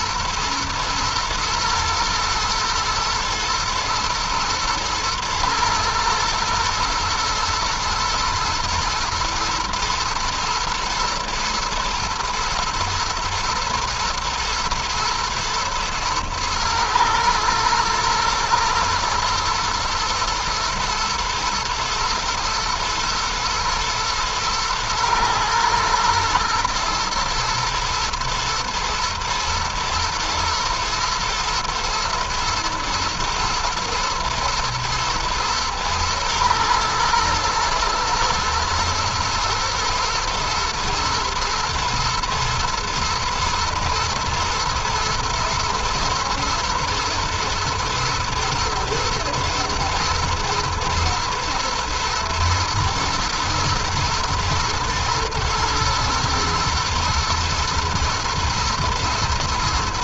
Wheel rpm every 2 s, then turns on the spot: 120, 120, 110, 110, 110, 110, 110, 110, 110, 120, 110, 120, 120, 120, 110, 110, 110, 110, 110, 120, 110, 110, 120, 110, 110, 110, 110, 110, 110, 110.
none